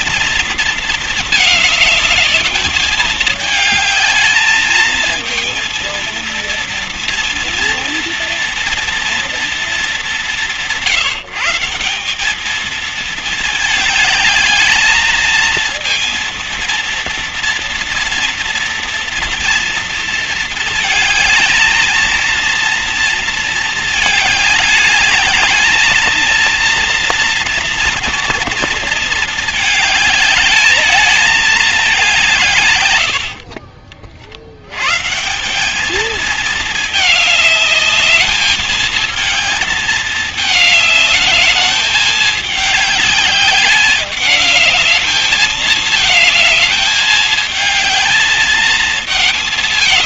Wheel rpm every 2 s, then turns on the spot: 230, 210, 220, 230, 230, 180, 220, 220, 230, 230, 220, 230, 210, 230, 230, 210, 120, 90, 210, 220, 210, 210, 210, 220, 220.
none